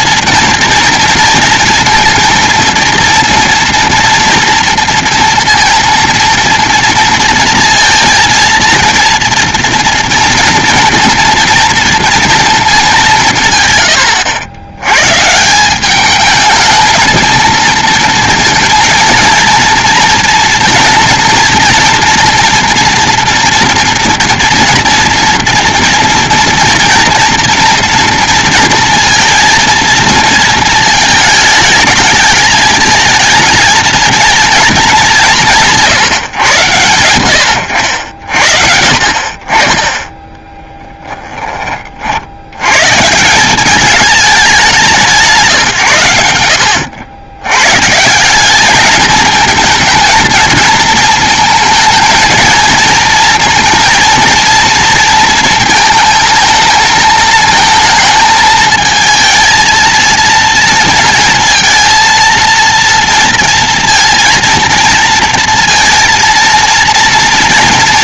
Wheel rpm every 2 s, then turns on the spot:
230, 230, 230, 230, 230, 230, 210, 110, 220, 230, 230, 240, 230, 230, 230, 220, 220, 220, 120, 60, 20, 110, 180, 90, 210, 230, 220, 230, 220, 220, 230, 230, 230, 230.
40-42